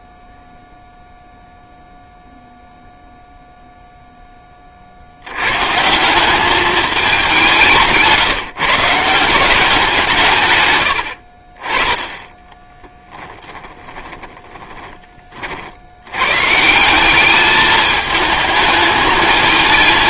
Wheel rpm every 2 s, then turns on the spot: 0, 0, 40, 210, 150, 100, 10, 20, 170, 220.
12-14